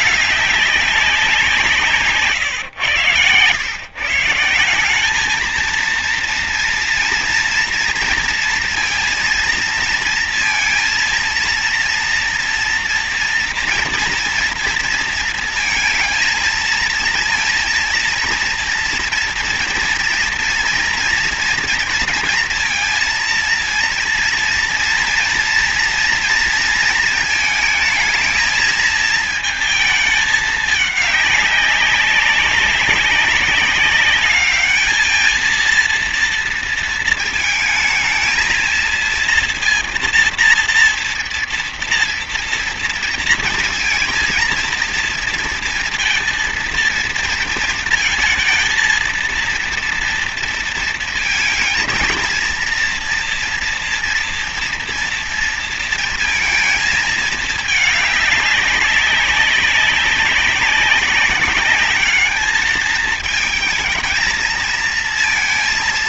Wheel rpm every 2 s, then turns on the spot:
200, 130, 180, 230, 230, 230, 230, 230, 230, 230, 230, 230, 230, 230, 220, 210, 190, 210, 230, 230, 230, 230, 230, 230, 220, 230, 230, 240, 230, 200, 190, 220, 230.
none